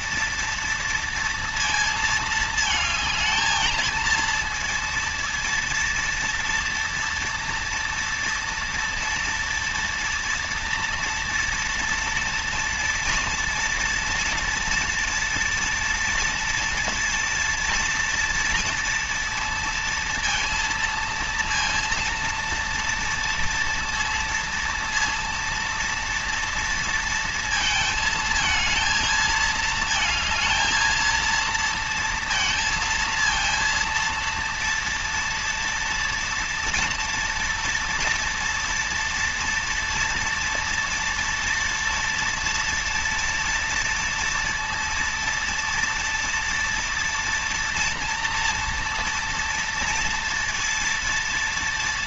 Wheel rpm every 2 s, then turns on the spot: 230, 220, 230, 230, 240, 230, 230, 230, 230, 230, 230, 230, 230, 230, 220, 220, 230, 230, 230, 230, 230, 230, 230, 230, 230, 230.
none